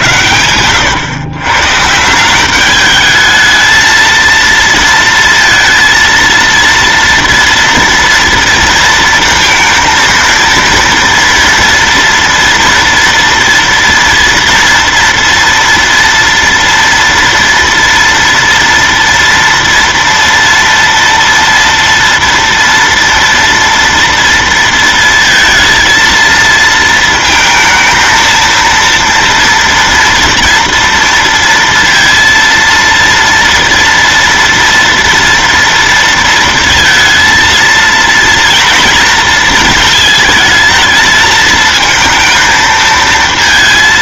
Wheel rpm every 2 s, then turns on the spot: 100, 190, 230, 230, 230, 230, 230, 230, 240, 230, 230, 230, 230, 220, 230, 230, 230, 240, 230, 230, 220, 220.
0-2